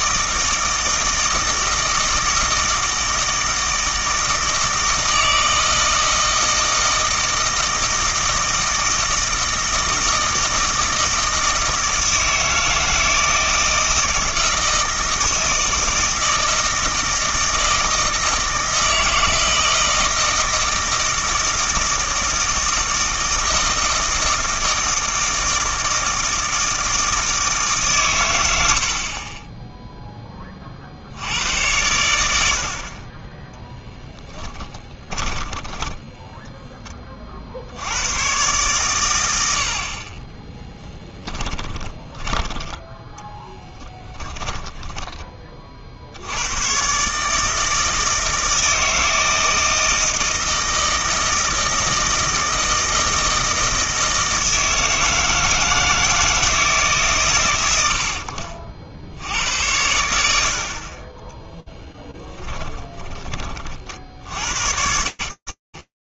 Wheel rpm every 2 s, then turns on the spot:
160, 160, 160, 160, 160, 160, 160, 160, 160, 160, 160, 160, 160, 160, 90, 30, 80, 10, 10, 120, 10, 10, 10, 90, 160, 160, 160, 160, 160, 60, 50, 20, 90.
34-36 40-46 58-60 62-64